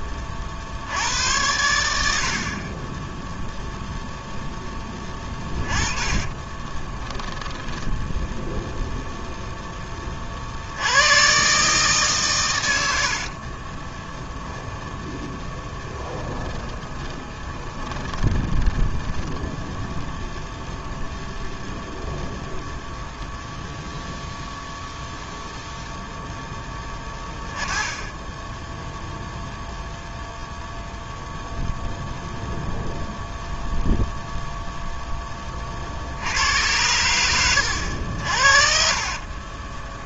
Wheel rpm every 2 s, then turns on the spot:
80, 20, 10, 20, 0, 90, 80, 10, 10, 10, 0, 0, 0, 10, 0, 0, 0, 10, 100, 50.
4-8 12-20 38-40